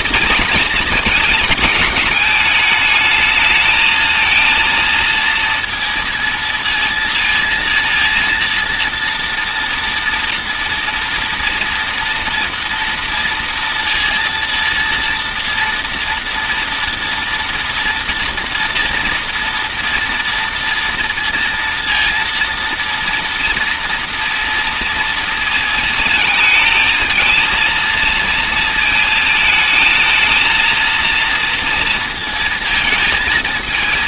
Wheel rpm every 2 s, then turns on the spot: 230, 210, 230, 230, 230, 230, 230, 230, 230, 240, 230, 230, 230, 220, 220, 220, 220.
none